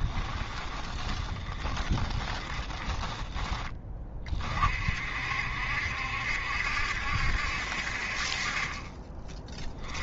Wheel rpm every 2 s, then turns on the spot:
20, 20, 50, 70, 30.
0-4